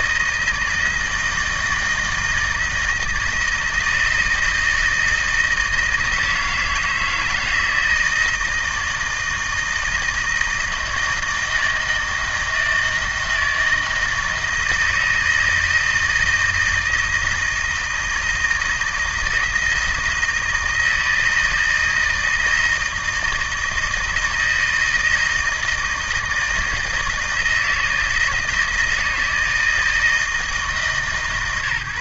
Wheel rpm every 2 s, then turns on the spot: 160, 160, 160, 160, 160, 160, 160, 160, 160, 160, 160, 160, 160, 160, 160, 150.
none